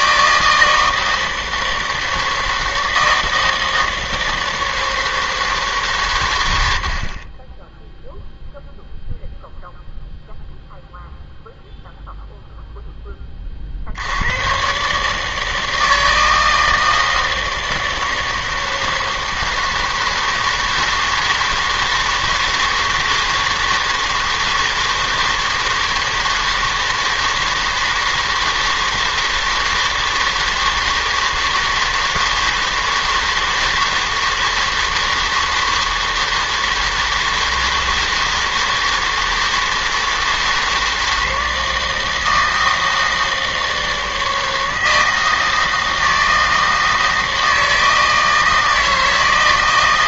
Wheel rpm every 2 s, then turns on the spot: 160, 160, 160, 70, 0, 0, 0, 130, 160, 160, 160, 160, 160, 160, 160, 160, 160, 160, 160, 160, 160, 160, 160, 160, 160.
none